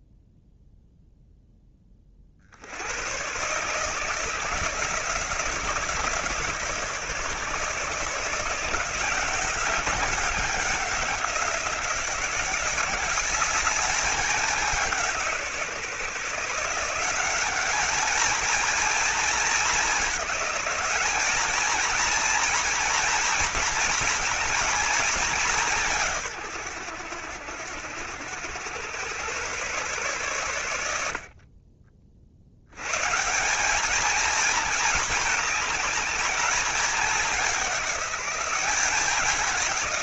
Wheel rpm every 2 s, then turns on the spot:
0, 80, 160, 160, 170, 180, 190, 180, 170, 230, 200, 230, 220, 110, 110, 90, 110, 220, 210, 190.
none